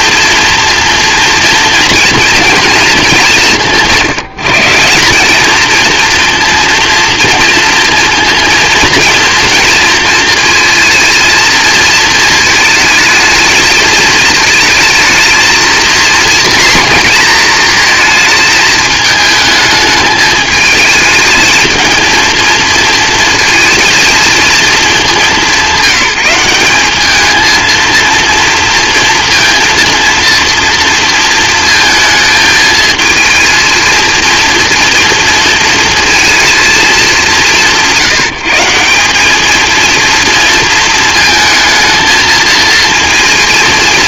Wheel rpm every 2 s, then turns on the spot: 230, 230, 190, 230, 230, 230, 220, 220, 230, 220, 210, 230, 220, 190, 230, 230, 220, 230, 210, 170, 230, 230.
none